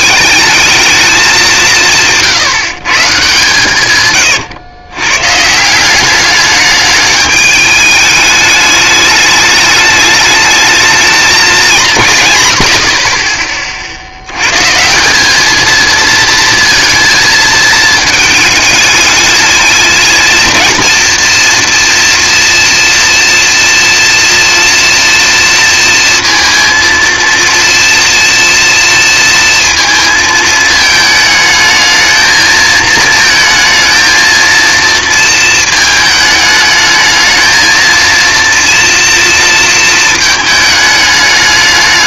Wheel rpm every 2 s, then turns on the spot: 220, 150, 110, 200, 210, 220, 110, 130, 230, 220, 230, 240, 230, 230, 230, 220, 220, 230, 210, 230, 220.
none